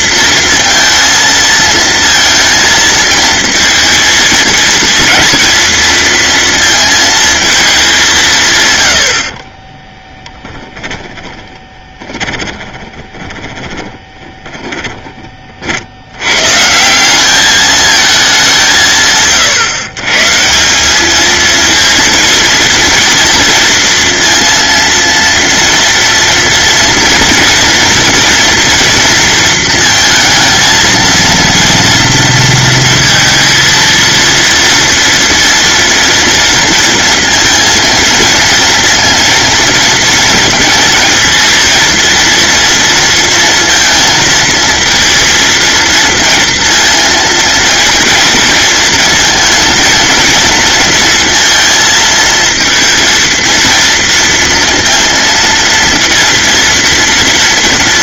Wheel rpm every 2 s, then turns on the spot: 230, 220, 230, 230, 100, 10, 20, 10, 160, 160, 190, 230, 230, 240, 240, 220, 230, 230, 230, 230, 230, 230, 230, 230, 220, 230, 230, 230, 230.
10-14